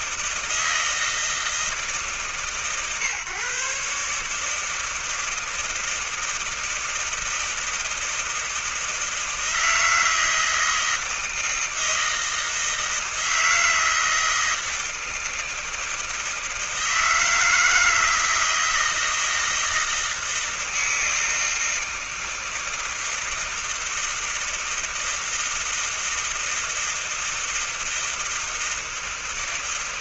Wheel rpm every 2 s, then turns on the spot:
160, 150, 140, 160, 160, 160, 160, 160, 160, 160, 160, 160, 160, 160, 160.
none